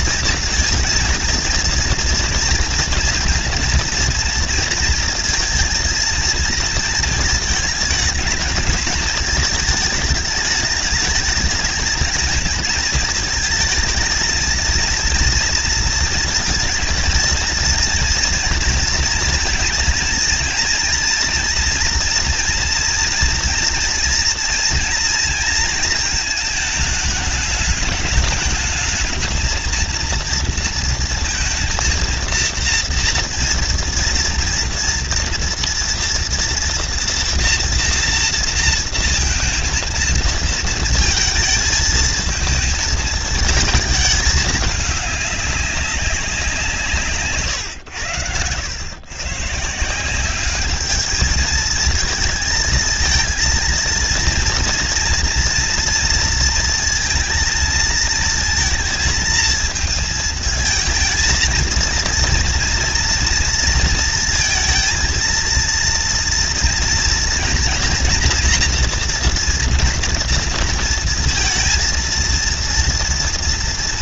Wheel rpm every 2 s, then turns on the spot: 230, 240, 230, 230, 220, 210, 220, 220, 230, 240, 230, 240, 230, 230, 210, 230, 230, 230, 240, 230, 220, 220, 220, 190, 100, 180, 220, 230, 230, 230, 220, 230, 230, 230, 230, 230, 230.
none